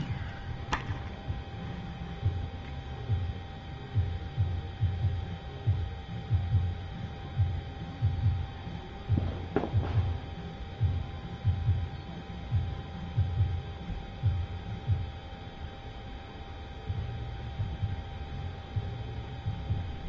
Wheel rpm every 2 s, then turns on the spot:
0, 0, 0, 0, 0, 0, 0, 0, 0, 0.
none